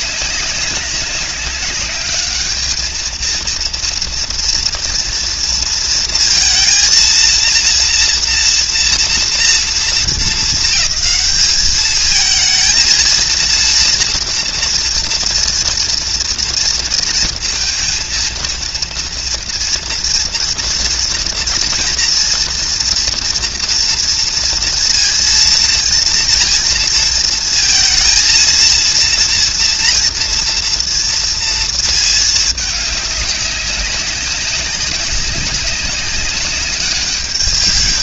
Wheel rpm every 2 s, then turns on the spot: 200, 210, 230, 230, 230, 220, 220, 230, 230, 230, 230, 240, 230, 230, 230, 230, 210, 190, 200.
none